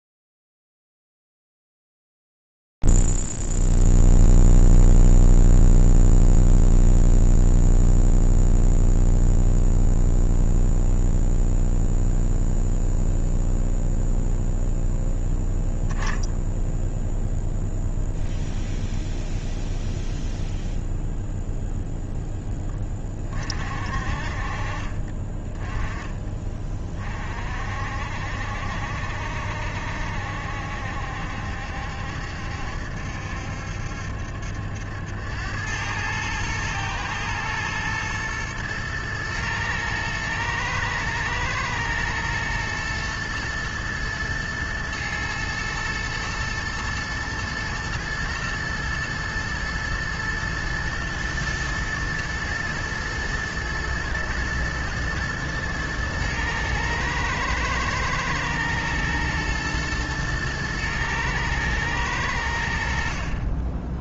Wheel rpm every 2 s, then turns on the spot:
0, 0, 0, 0, 0, 0, 0, 0, 0, 0, 0, 10, 40, 30, 70, 70, 70, 80, 110, 120, 110, 110, 120, 110, 110, 120, 110, 110, 110, 120, 110, 80.
none